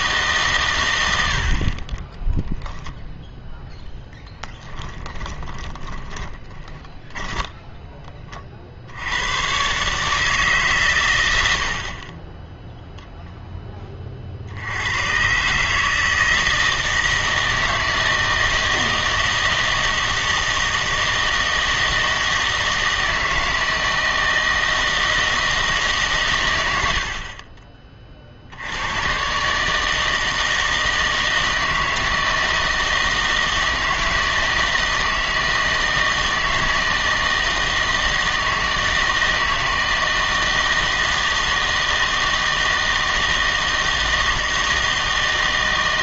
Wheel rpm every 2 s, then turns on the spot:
130, 0, 10, 10, 50, 140, 0, 70, 160, 160, 160, 160, 160, 110, 80, 160, 160, 160, 160, 160, 170, 160, 160.
4-8